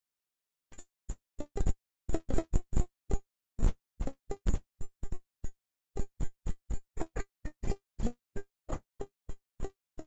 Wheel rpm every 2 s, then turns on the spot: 0, 0, 0, 0, 0.
none